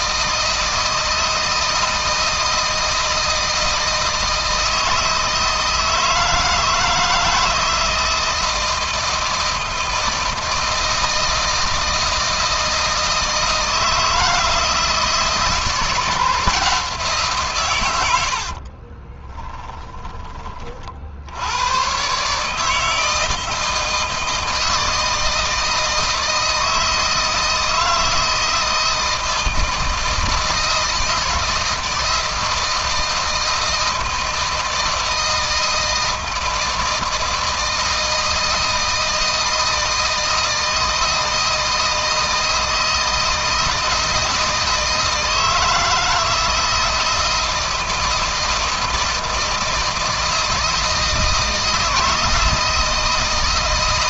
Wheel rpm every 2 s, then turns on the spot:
160, 160, 160, 160, 160, 160, 160, 160, 170, 40, 50, 160, 160, 160, 160, 160, 160, 160, 160, 160, 160, 160, 160, 160, 160, 160, 160.
18-20